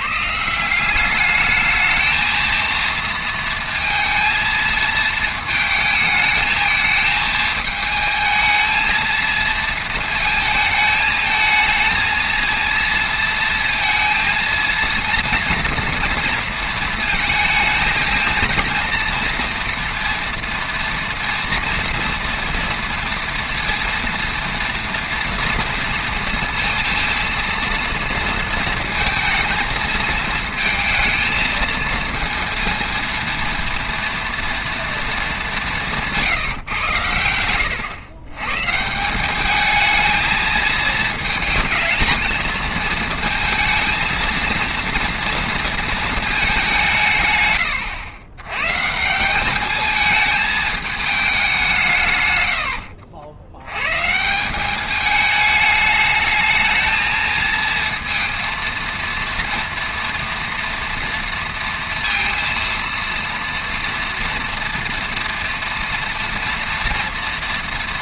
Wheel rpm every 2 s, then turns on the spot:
160, 230, 230, 220, 220, 220, 230, 230, 230, 230, 230, 230, 230, 230, 230, 230, 230, 230, 150, 130, 220, 220, 230, 200, 120, 220, 90, 180, 220, 230, 230, 230, 230, 230.
52-54